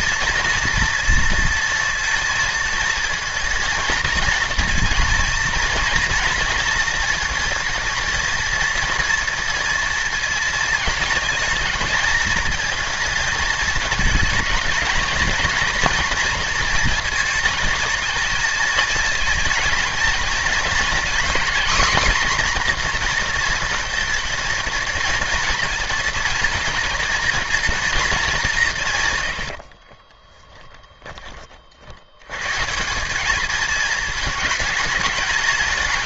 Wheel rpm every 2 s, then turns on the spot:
230, 230, 230, 230, 230, 220, 220, 220, 230, 220, 220, 240, 230, 230, 190, 10, 140, 210.
30-32